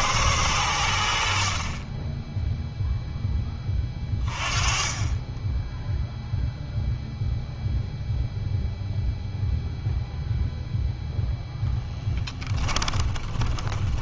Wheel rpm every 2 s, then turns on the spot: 90, 0, 30, 0, 0, 0, 20.
12-14